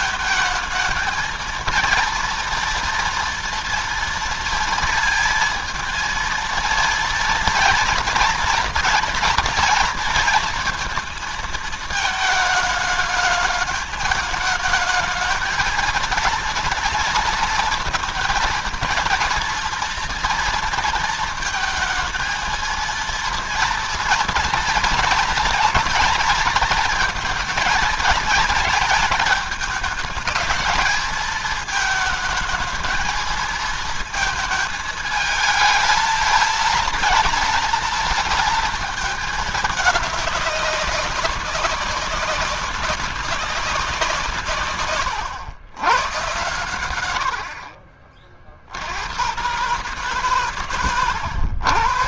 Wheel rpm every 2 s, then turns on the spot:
220, 230, 230, 230, 240, 230, 220, 220, 230, 230, 230, 220, 230, 230, 220, 220, 220, 220, 230, 220, 200, 190, 120, 110, 70, 110.
none